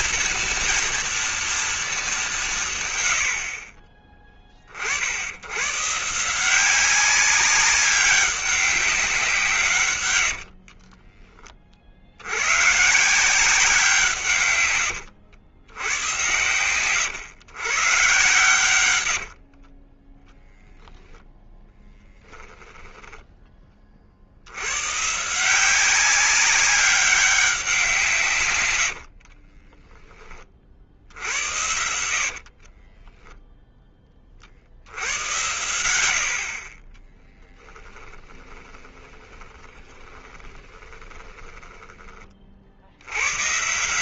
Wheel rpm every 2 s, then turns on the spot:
230, 150, 30, 180, 200, 60, 110, 140, 110, 110, 0, 10, 80, 200, 120, 40, 50, 60, 40, 20, 20, 50.
10-12 22-24 32-34 38-42